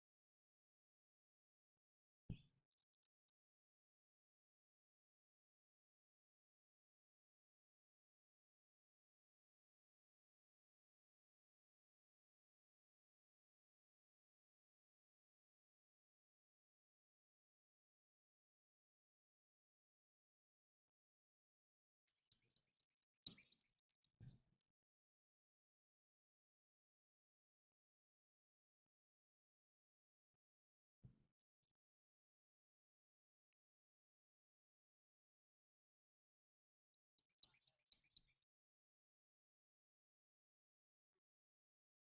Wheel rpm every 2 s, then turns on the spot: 0, 0, 0, 0, 0, 0, 0, 0, 0, 0, 0, 0, 0, 0, 0, 0, 0, 0, 0, 0, 0.
none